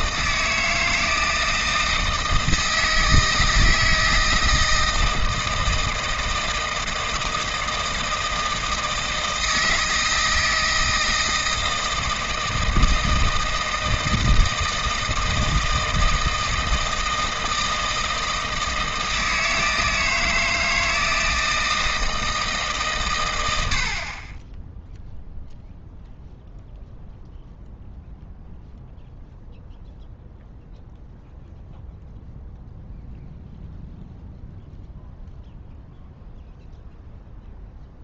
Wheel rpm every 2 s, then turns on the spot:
160, 160, 160, 160, 160, 160, 160, 160, 160, 160, 160, 150, 10, 0, 0, 0, 0, 0, 0.
none